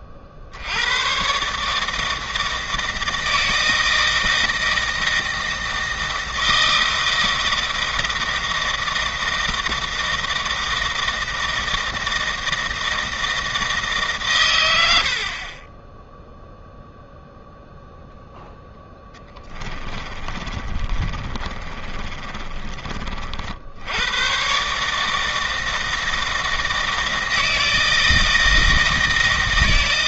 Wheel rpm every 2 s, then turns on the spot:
80, 160, 160, 160, 160, 160, 160, 90, 0, 0, 40, 30, 140, 160, 160.
20-22